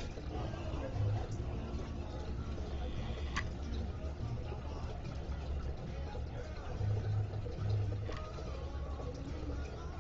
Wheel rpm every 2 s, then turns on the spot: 0, 0, 0, 0, 0.
none